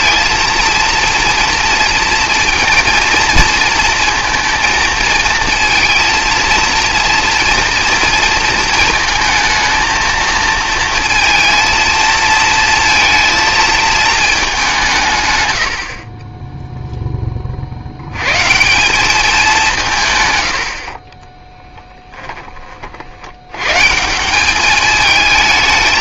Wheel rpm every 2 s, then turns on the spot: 230, 230, 230, 220, 230, 220, 230, 200, 0, 160, 80, 30, 200.
none